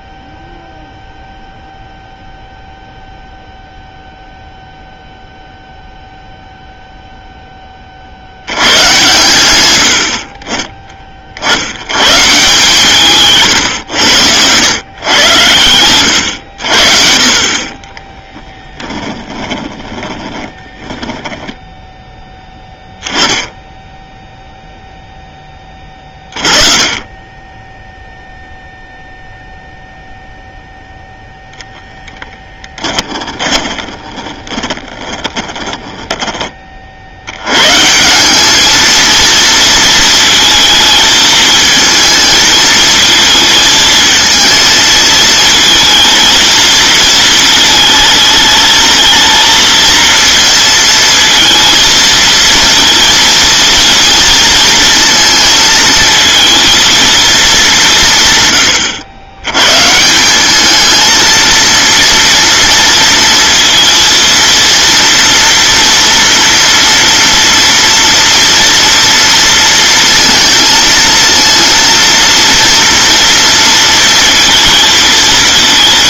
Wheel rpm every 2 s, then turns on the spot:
0, 0, 0, 0, 100, 30, 160, 110, 70, 20, 10, 10, 0, 40, 0, 0, 10, 20, 40, 220, 220, 220, 220, 230, 220, 220, 230, 230, 220, 120, 210, 230, 230, 230, 230, 220, 230, 220.
18-22 32-36